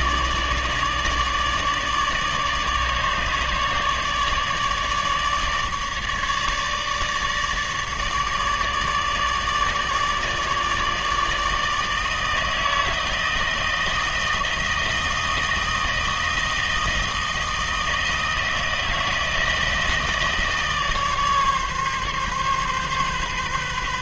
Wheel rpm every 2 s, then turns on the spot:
150, 150, 150, 150, 150, 150, 160, 160, 160, 160, 160, 140.
none